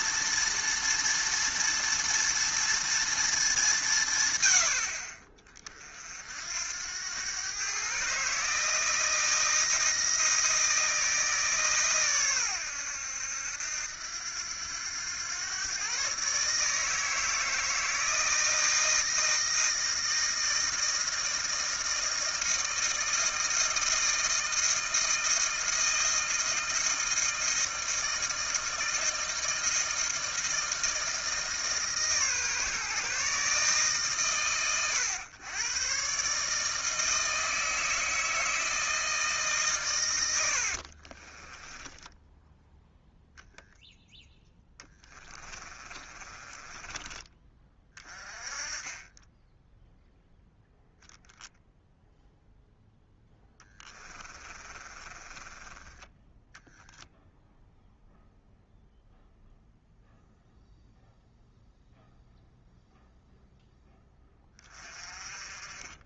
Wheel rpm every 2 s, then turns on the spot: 230, 230, 80, 90, 160, 160, 100, 100, 150, 160, 160, 160, 160, 160, 160, 160, 150, 110, 160, 160, 50, 0, 10, 20, 20, 0, 0, 30, 0, 0, 0, 0, 30.
40-42 44-48 54-56